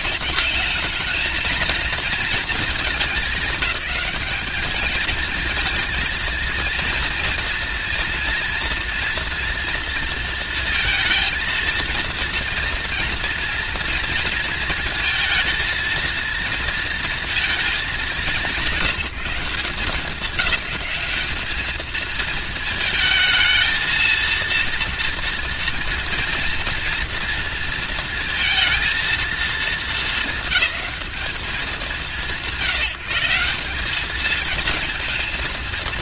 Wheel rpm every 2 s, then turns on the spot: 220, 220, 220, 230, 230, 230, 240, 230, 230, 170, 190, 220, 230, 230, 220, 210, 170, 220.
none